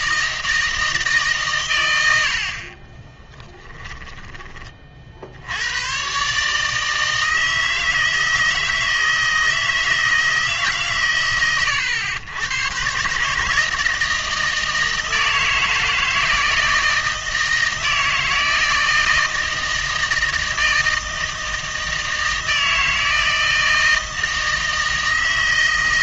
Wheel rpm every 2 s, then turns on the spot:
160, 50, 30, 150, 160, 140, 130, 160, 160, 160, 160, 160, 160.
none